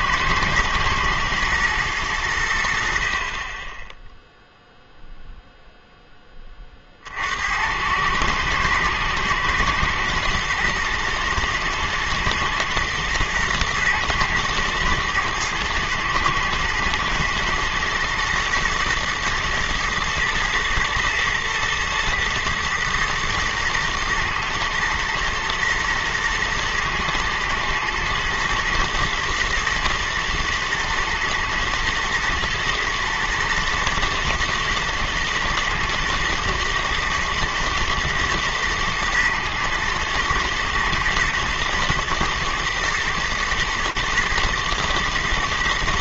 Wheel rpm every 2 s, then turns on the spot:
120, 70, 0, 30, 110, 120, 110, 110, 110, 120, 110, 120, 110, 110, 120, 120, 120, 110, 120, 120, 120, 110, 110.
none